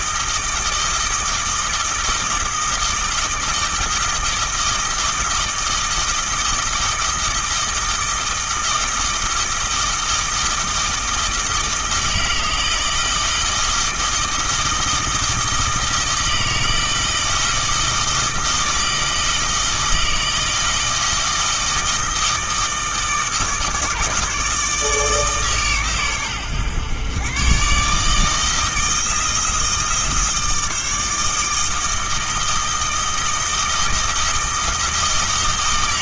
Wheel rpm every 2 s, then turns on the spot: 160, 160, 160, 160, 160, 160, 160, 160, 160, 160, 160, 160, 150, 120, 160, 160, 160, 160.
none